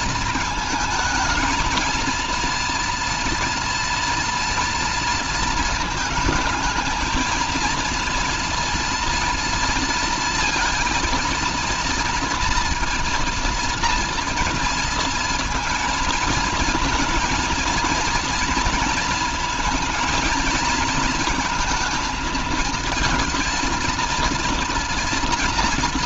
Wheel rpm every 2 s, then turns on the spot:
220, 230, 230, 220, 230, 230, 230, 230, 230, 230, 230, 230, 230.
none